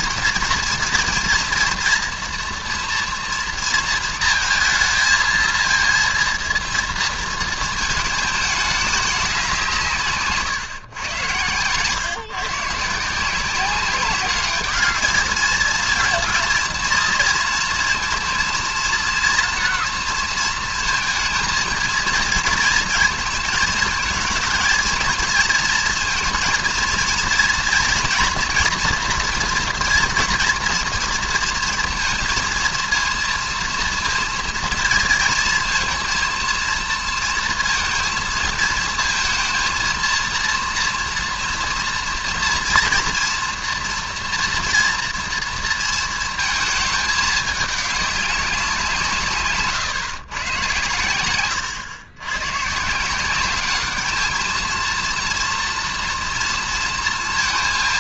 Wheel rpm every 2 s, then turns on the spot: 230, 230, 230, 230, 210, 130, 150, 210, 230, 230, 220, 230, 220, 230, 240, 240, 230, 230, 230, 230, 230, 230, 240, 220, 180, 120, 130, 230, 230.
none